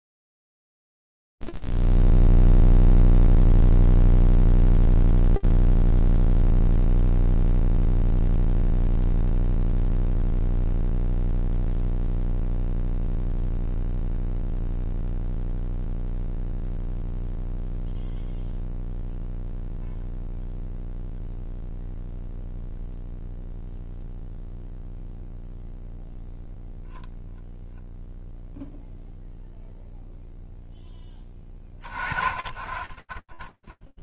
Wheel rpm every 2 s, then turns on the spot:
0, 0, 0, 0, 0, 0, 0, 0, 0, 0, 0, 0, 0, 0, 0, 20, 20.
none